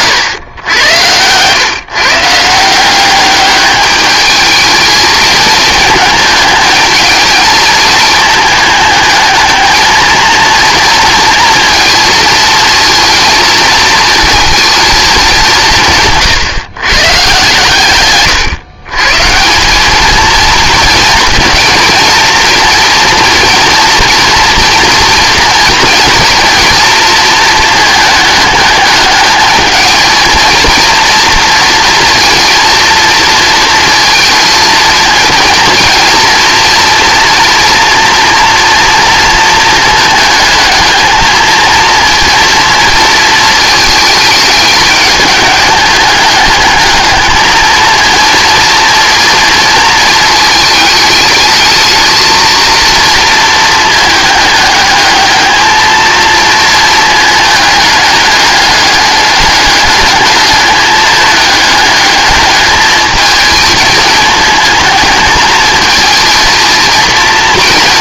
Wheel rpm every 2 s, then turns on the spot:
100, 170, 220, 220, 210, 230, 230, 230, 140, 130, 230, 230, 240, 230, 210, 230, 230, 230, 230, 230, 220, 230, 210, 210, 230, 220, 230, 210, 230, 210, 210, 210, 220, 230.
none